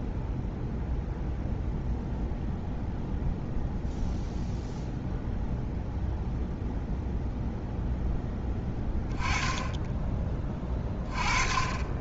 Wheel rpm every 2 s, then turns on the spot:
0, 0, 0, 0, 10, 30.
none